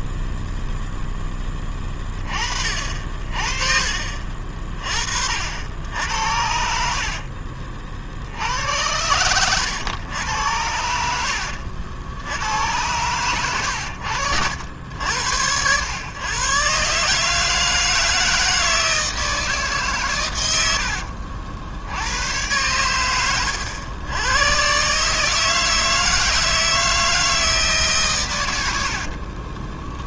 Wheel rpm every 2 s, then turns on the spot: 0, 50, 40, 60, 90, 70, 90, 80, 140, 160, 80, 100, 140, 160, 70.
6-8 20-22 28-30